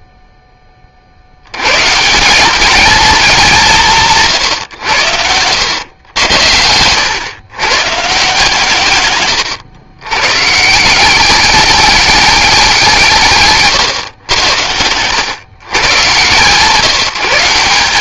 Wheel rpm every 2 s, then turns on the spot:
20, 210, 120, 90, 130, 170, 180, 100, 160.
6-8